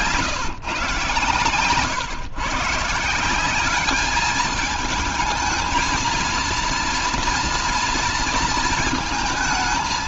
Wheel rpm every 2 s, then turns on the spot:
130, 150, 210, 230, 220.
none